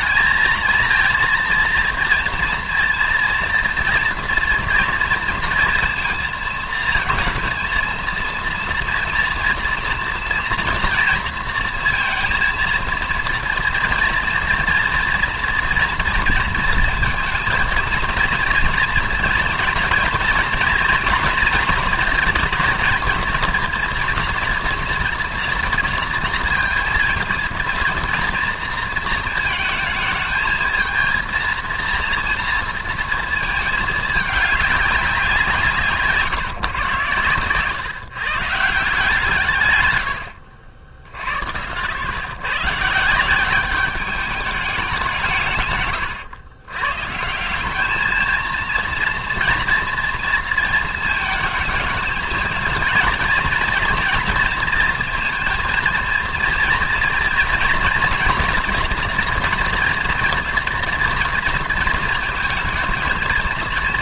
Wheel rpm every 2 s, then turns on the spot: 230, 230, 230, 230, 240, 230, 230, 230, 230, 230, 230, 230, 230, 230, 230, 220, 230, 190, 120, 150, 60, 150, 180, 140, 230, 220, 230, 230, 230, 230, 230, 230.
none